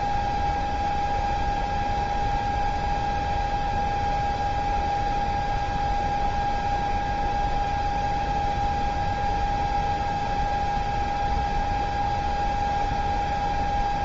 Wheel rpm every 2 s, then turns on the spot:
0, 0, 0, 0, 0, 0, 0.
none